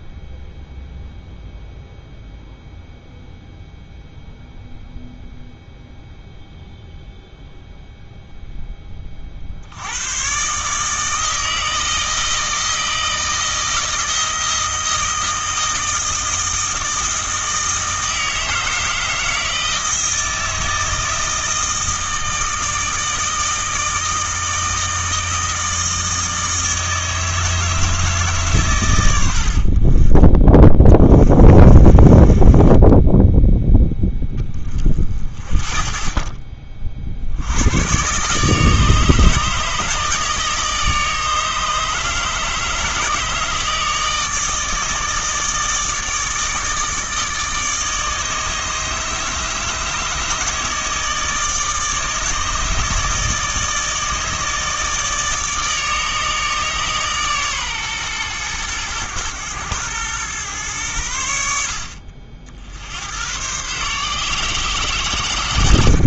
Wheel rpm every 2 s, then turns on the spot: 0, 0, 0, 0, 10, 140, 160, 160, 160, 160, 160, 160, 160, 160, 120, 20, 20, 20, 30, 150, 150, 150, 160, 150, 150, 150, 160, 150, 150, 110, 110, 70, 120.
none